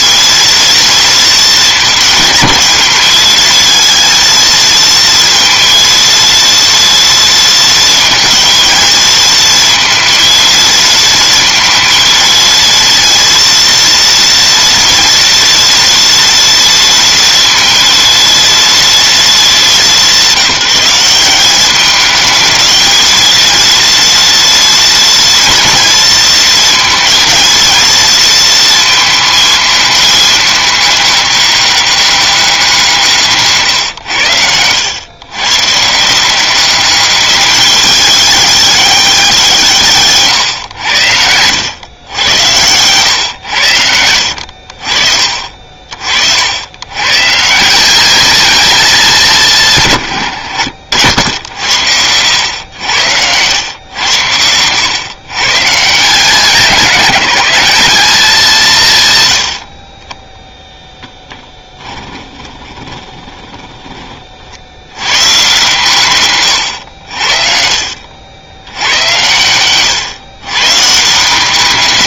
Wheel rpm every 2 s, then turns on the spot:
230, 220, 230, 230, 220, 230, 230, 230, 240, 220, 190, 220, 230, 230, 220, 210, 180, 110, 200, 200, 90, 110, 50, 120, 210, 80, 100, 120, 190, 140, 10, 20, 100, 80, 90, 140.
40-44 62-64